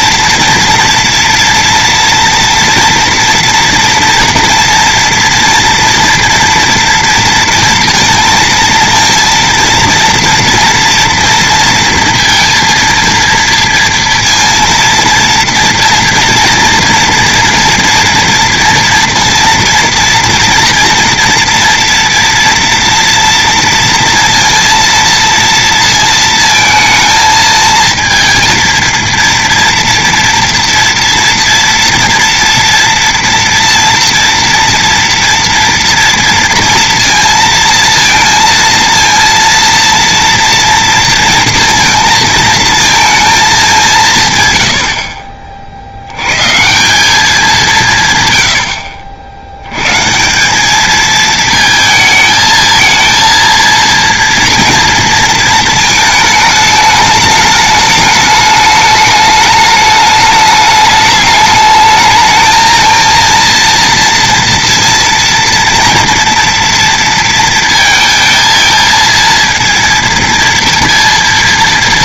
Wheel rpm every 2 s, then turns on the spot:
230, 230, 240, 230, 230, 230, 230, 230, 230, 230, 230, 240, 230, 230, 230, 230, 230, 230, 230, 230, 230, 230, 100, 140, 90, 210, 220, 230, 220, 210, 210, 220, 230, 230, 230, 230.
none